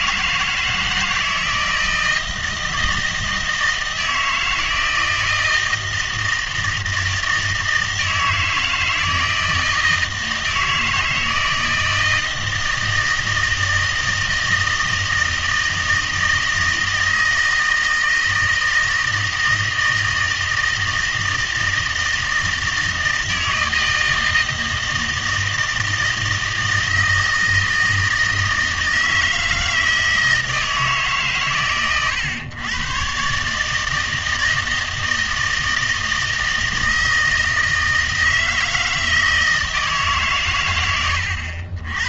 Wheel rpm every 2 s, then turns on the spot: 160, 160, 160, 160, 160, 160, 160, 160, 160, 160, 160, 160, 160, 160, 160, 160, 120, 160, 160, 160, 120.
none